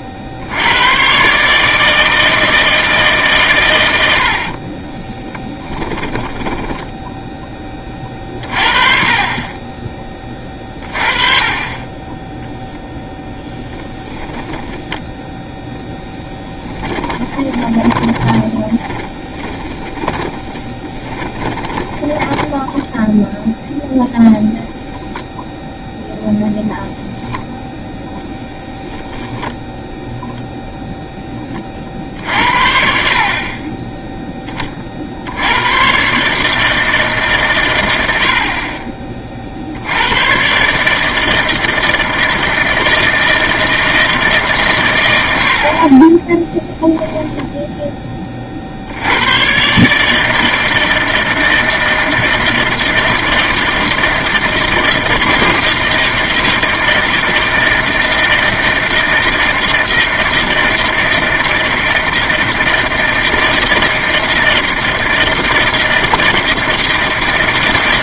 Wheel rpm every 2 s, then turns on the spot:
110, 160, 20, 10, 30, 30, 0, 20, 20, 20, 10, 10, 0, 0, 0, 0, 70, 40, 160, 40, 150, 160, 120, 10, 70, 160, 160, 160, 160, 160, 160, 160, 160, 160.
4-8 14-24 46-48